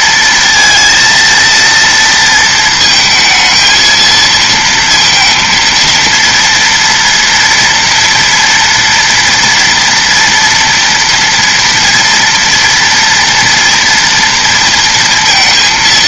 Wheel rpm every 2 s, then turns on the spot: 230, 220, 230, 230, 240, 240, 240, 230.
none